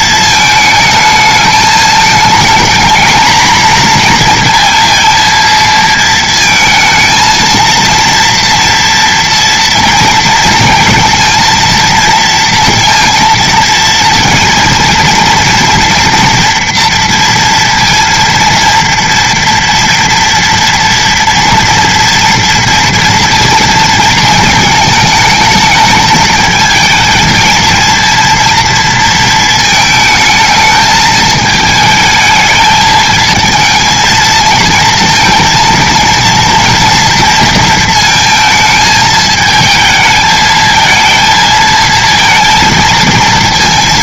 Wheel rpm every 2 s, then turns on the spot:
220, 220, 230, 220, 240, 230, 230, 230, 230, 230, 230, 230, 220, 220, 230, 220, 220, 220, 230, 220, 220, 230.
none